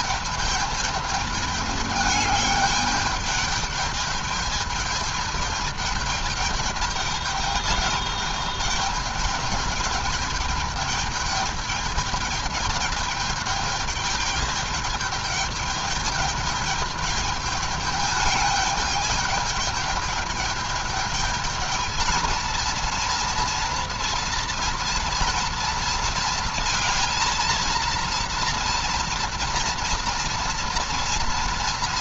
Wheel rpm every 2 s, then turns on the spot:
210, 210, 210, 210, 210, 210, 210, 210, 210, 210, 210, 230, 230, 230, 240, 240.
none